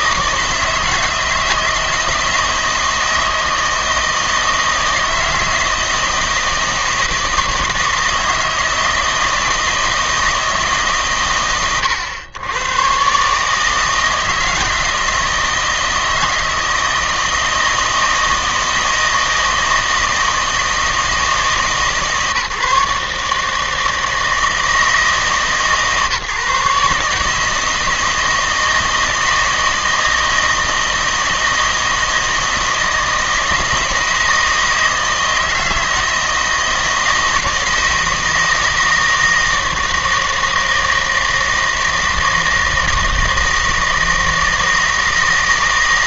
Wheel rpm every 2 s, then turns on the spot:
160, 160, 160, 160, 160, 150, 110, 160, 160, 160, 160, 150, 160, 140, 160, 160, 160, 160, 160, 160, 160, 160, 160.
none